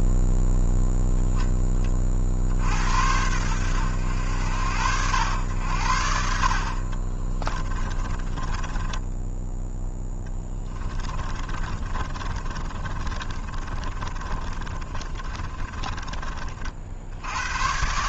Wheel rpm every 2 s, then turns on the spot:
0, 80, 80, 40, 20, 20, 30, 30, 60.
6-16